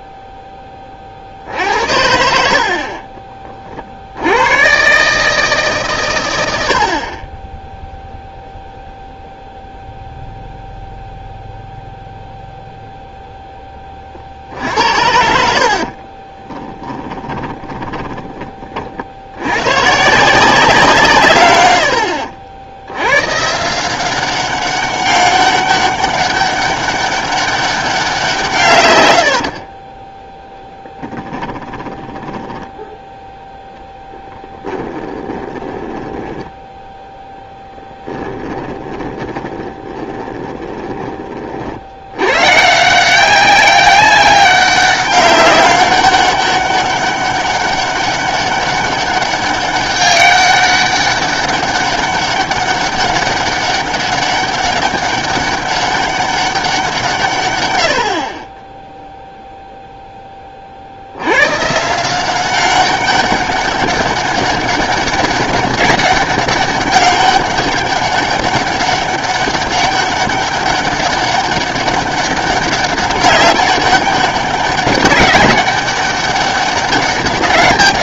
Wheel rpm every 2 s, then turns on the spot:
20, 60, 110, 80, 0, 0, 0, 70, 20, 40, 170, 80, 190, 200, 130, 10, 10, 20, 10, 20, 20, 150, 200, 200, 200, 200, 200, 200, 180, 20, 40, 190, 200, 200, 200, 200, 200, 200, 200.
16-18 30-32 34-42